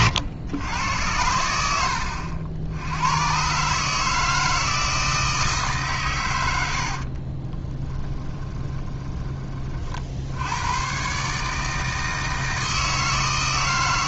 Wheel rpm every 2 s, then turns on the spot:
100, 90, 160, 70, 20, 110, 160.
6-10